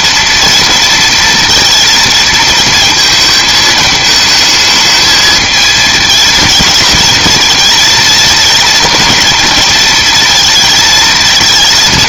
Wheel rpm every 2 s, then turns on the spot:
230, 220, 220, 220, 230, 220.
none